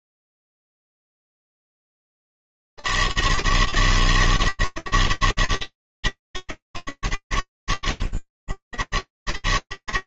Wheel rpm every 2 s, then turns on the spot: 80, 160, 160, 90, 80.
none